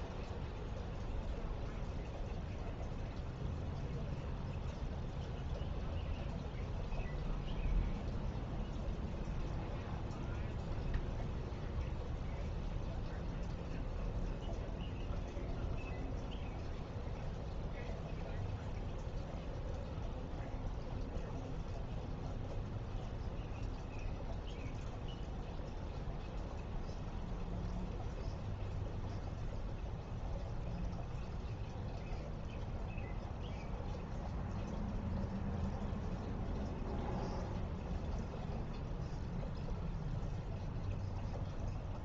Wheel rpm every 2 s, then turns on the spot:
0, 0, 0, 0, 0, 0, 0, 0, 0, 0, 0, 0, 0, 0, 0, 0, 0, 0, 0, 0, 0.
none